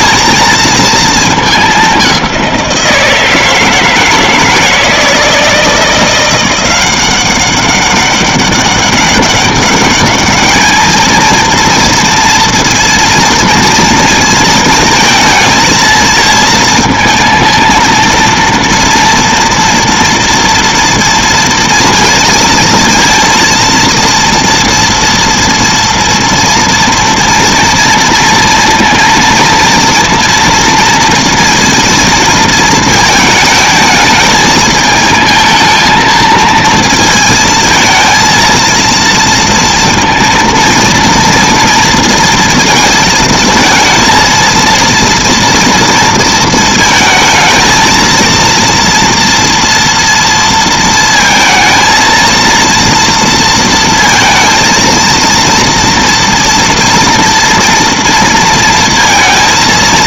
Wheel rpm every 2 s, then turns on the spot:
230, 180, 160, 180, 200, 210, 230, 220, 230, 230, 230, 230, 230, 230, 230, 230, 230, 220, 230, 230, 230, 230, 230, 230, 230, 230, 230, 230, 230, 230.
none